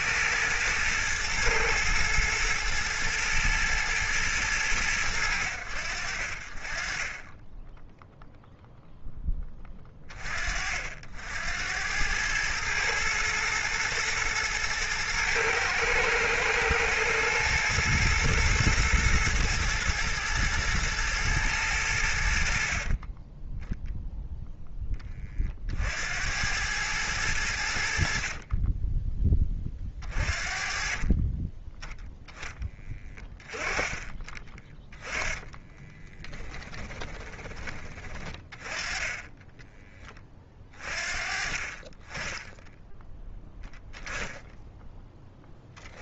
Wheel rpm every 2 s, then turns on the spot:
110, 120, 80, 10, 10, 80, 120, 110, 120, 110, 110, 20, 20, 90, 20, 30, 30, 20, 20, 20, 40, 0, 10.
22-24 30-32 34-38